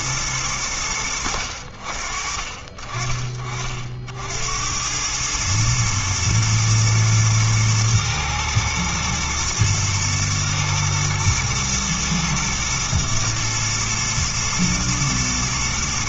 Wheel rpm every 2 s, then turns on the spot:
100, 40, 80, 110, 110, 110, 120, 110.
none